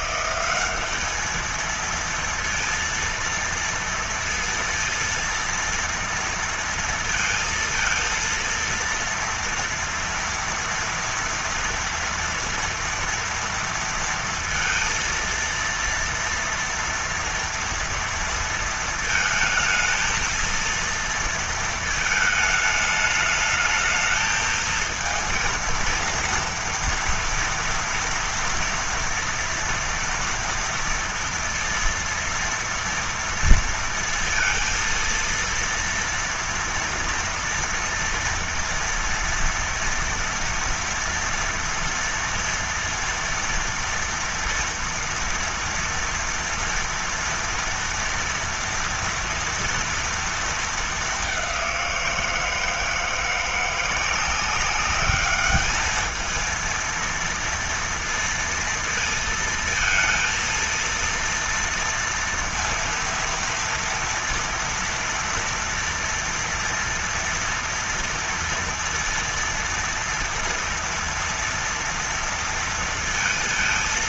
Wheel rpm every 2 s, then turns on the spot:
200, 230, 230, 230, 230, 230, 230, 230, 230, 230, 230, 220, 220, 230, 230, 230, 230, 230, 230, 230, 230, 230, 230, 230, 230, 220, 160, 190, 230, 230, 230, 230, 230, 230, 230, 230, 230.
none